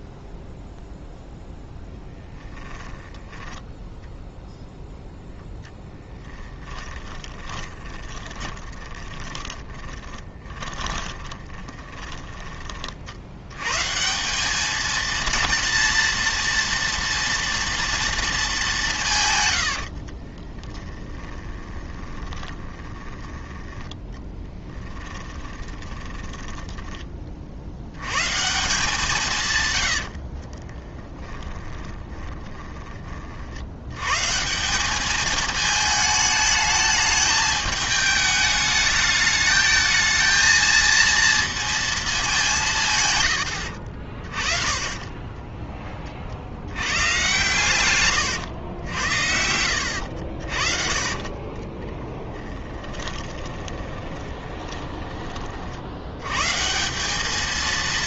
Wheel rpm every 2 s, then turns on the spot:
0, 20, 0, 10, 20, 20, 30, 220, 230, 210, 10, 20, 10, 10, 170, 30, 20, 180, 220, 210, 220, 160, 30, 90, 90, 40, 20, 20, 160.
6-12 20-28 30-32 50-56